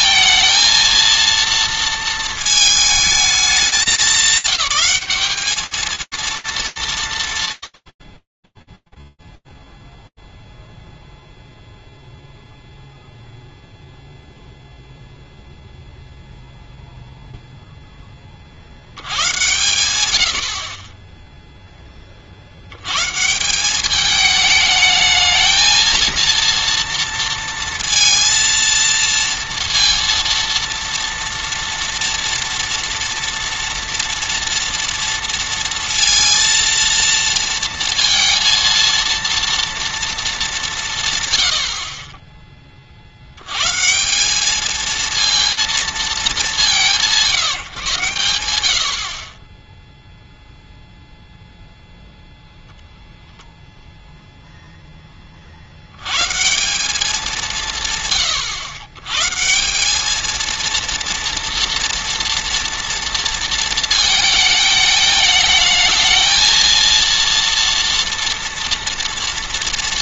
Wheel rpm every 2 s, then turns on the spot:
230, 220, 200, 180, 0, 0, 0, 0, 0, 110, 10, 200, 230, 230, 230, 230, 230, 230, 230, 230, 40, 190, 200, 120, 0, 0, 0, 90, 130, 190, 230, 220, 220, 230, 230.
none